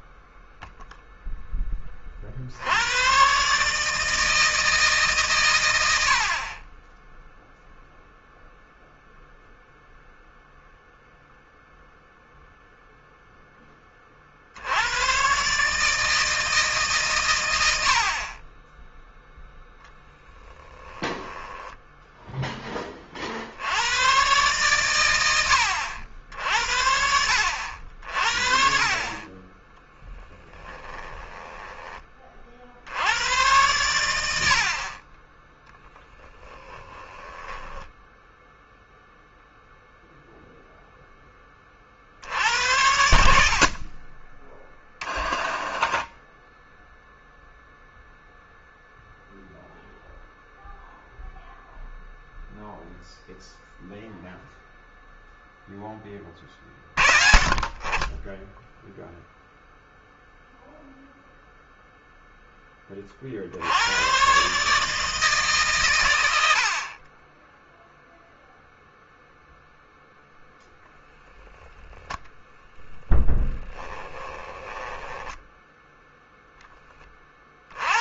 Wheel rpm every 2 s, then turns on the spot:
0, 90, 150, 10, 0, 0, 0, 80, 140, 10, 10, 10, 120, 70, 40, 10, 60, 50, 10, 0, 0, 80, 20, 0, 0, 0, 0, 0, 30, 10, 0, 20, 140, 60, 0, 0, 0, 10, 10.
20-22 30-32 36-38 74-76